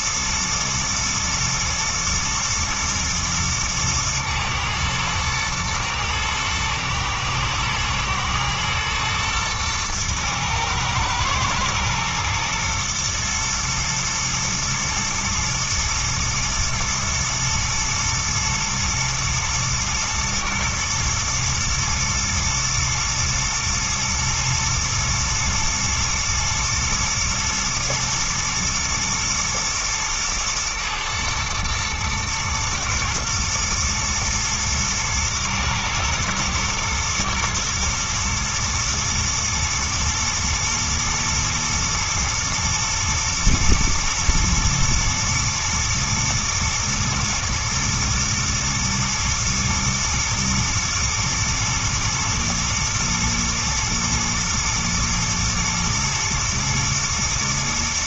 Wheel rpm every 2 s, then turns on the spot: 120, 120, 110, 110, 110, 110, 120, 120, 110, 120, 110, 110, 110, 110, 110, 110, 120, 110, 120, 120, 120, 120, 110, 110, 120, 110, 110, 120, 120.
none